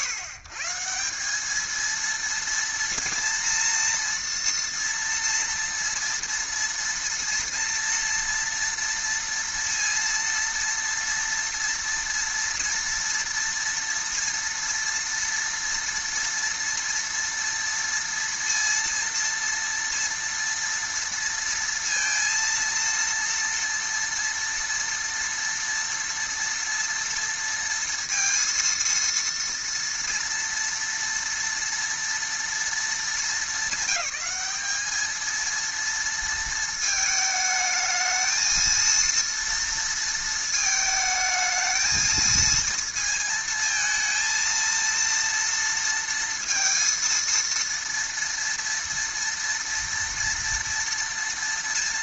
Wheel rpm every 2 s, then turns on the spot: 140, 230, 230, 230, 230, 230, 230, 230, 230, 230, 230, 230, 240, 230, 230, 230, 220, 210, 220, 230, 220, 230, 230, 230, 230, 230.
none